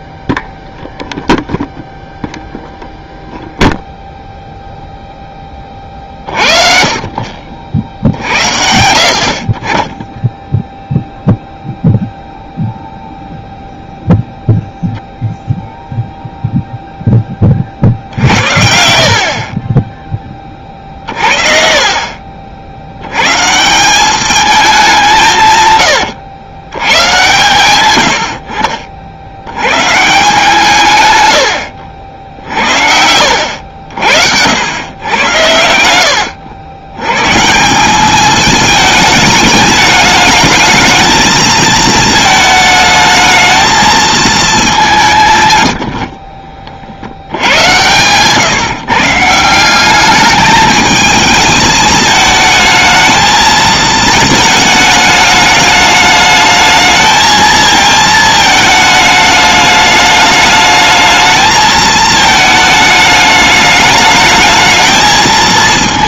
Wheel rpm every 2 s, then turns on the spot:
0, 0, 0, 30, 60, 0, 0, 0, 0, 60, 40, 70, 200, 100, 60, 160, 60, 100, 90, 220, 220, 220, 210, 50, 140, 210, 220, 220, 220, 220, 220, 220, 220.
32-34